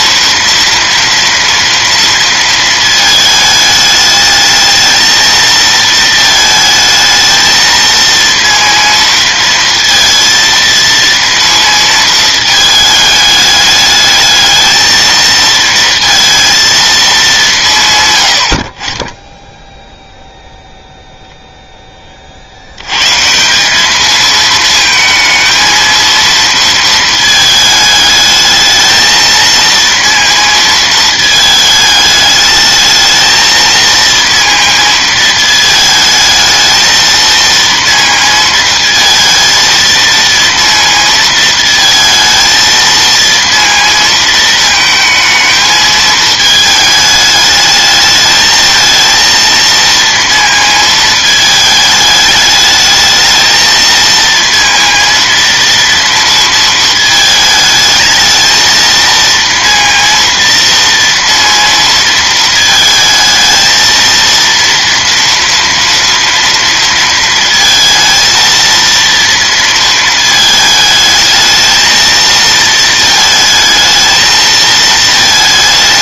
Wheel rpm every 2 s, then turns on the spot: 230, 220, 220, 220, 230, 230, 220, 220, 230, 50, 0, 80, 220, 230, 220, 220, 220, 230, 220, 230, 230, 230, 220, 220, 220, 230, 210, 230, 230, 220, 230, 220, 230, 230, 230, 220, 220, 220.
none